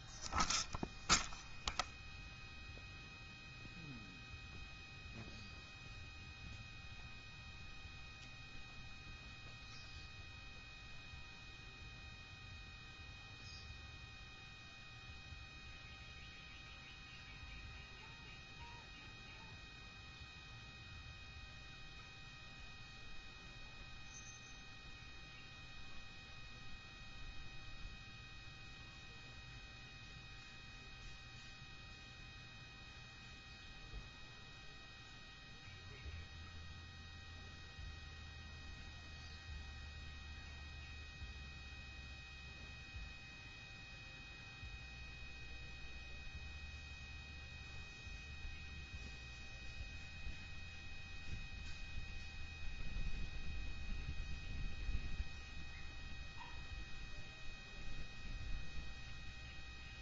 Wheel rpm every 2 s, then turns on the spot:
0, 0, 0, 0, 0, 0, 0, 0, 0, 0, 0, 0, 0, 0, 0, 0, 0, 0, 0, 0, 0, 0, 0, 0, 0, 0, 0, 0, 0, 0.
none